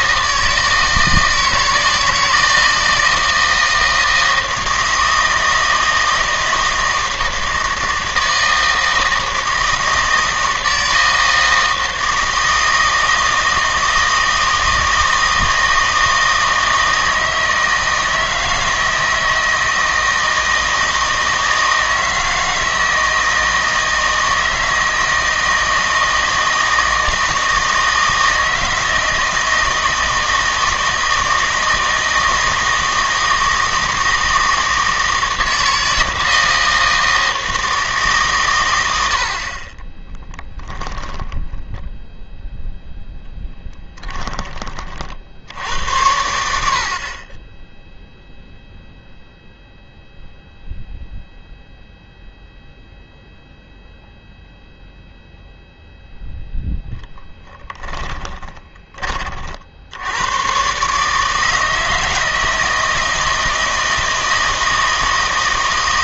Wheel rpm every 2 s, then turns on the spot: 160, 160, 160, 160, 160, 160, 160, 160, 160, 160, 160, 160, 160, 160, 160, 160, 160, 160, 160, 90, 20, 0, 30, 70, 0, 0, 0, 0, 10, 20, 140, 160, 160.
40-42